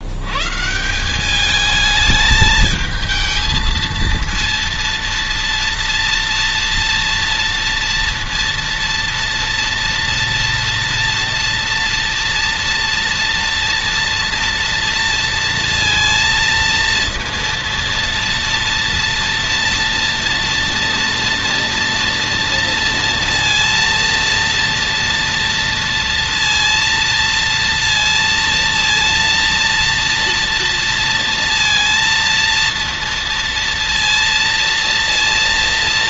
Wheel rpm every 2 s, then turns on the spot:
190, 220, 230, 230, 230, 230, 230, 230, 230, 230, 230, 230, 230, 230, 230, 230, 230, 230.
none